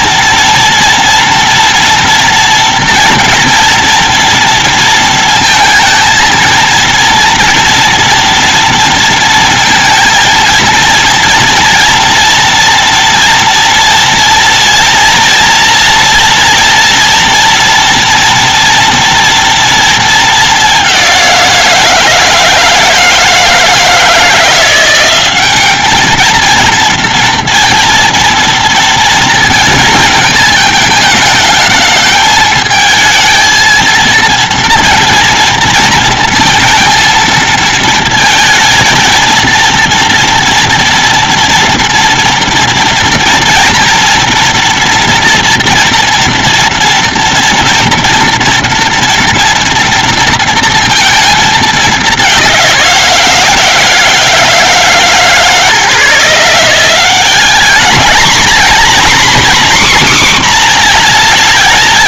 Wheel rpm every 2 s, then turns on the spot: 230, 240, 230, 230, 230, 230, 230, 230, 230, 230, 220, 160, 170, 220, 230, 220, 220, 230, 230, 230, 230, 230, 230, 230, 230, 230, 200, 160, 160, 230, 260.
none